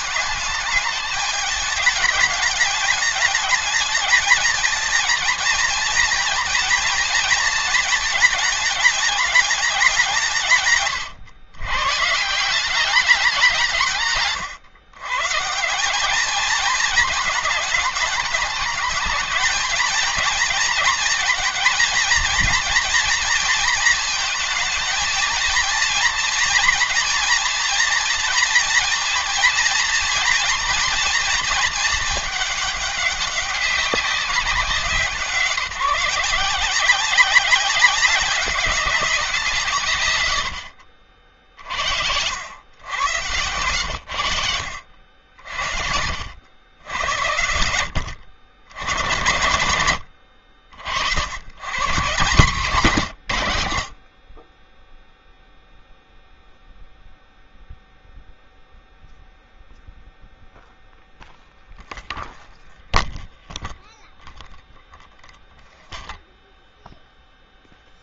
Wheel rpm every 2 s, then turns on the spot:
210, 220, 230, 230, 210, 160, 190, 110, 220, 210, 230, 230, 220, 240, 230, 230, 210, 180, 180, 190, 60, 100, 70, 90, 90, 60, 160, 10, 0, 0, 0, 0, 0, 0.
none